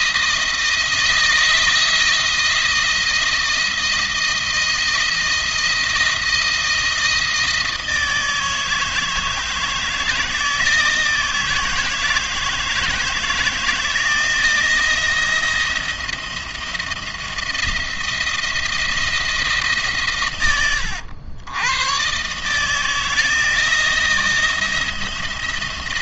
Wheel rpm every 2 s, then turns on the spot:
160, 170, 170, 160, 160, 160, 160, 170, 170, 170, 100, 160, 170.
none